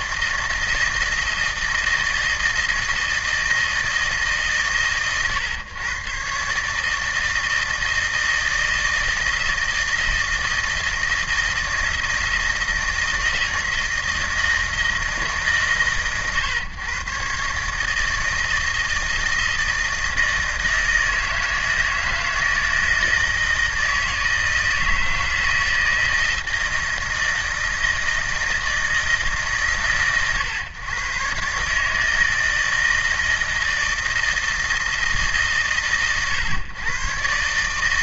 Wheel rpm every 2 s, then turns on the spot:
160, 160, 130, 150, 160, 160, 160, 160, 130, 160, 160, 160, 160, 160, 160, 110, 160, 160, 120.
none